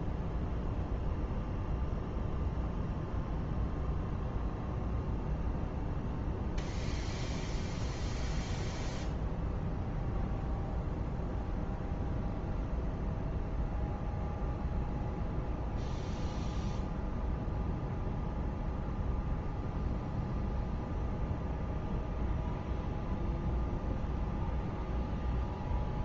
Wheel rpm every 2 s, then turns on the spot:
0, 0, 0, 0, 0, 0, 0, 0, 0, 0, 0, 0, 0.
none